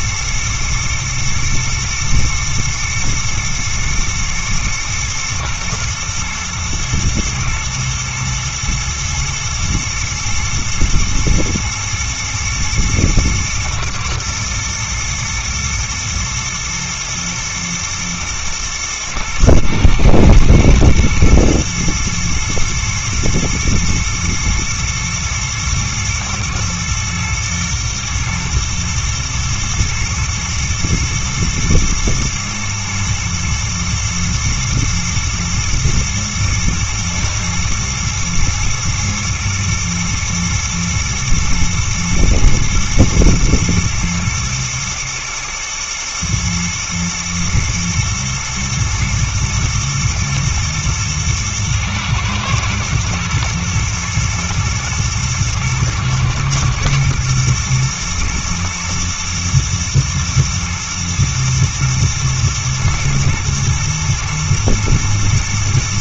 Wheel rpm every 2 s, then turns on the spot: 120, 110, 110, 110, 110, 120, 110, 120, 110, 110, 110, 110, 120, 120, 110, 120, 110, 120, 110, 110, 110, 110, 110, 110, 120, 120, 120, 120, 110, 120, 120, 120, 110.
none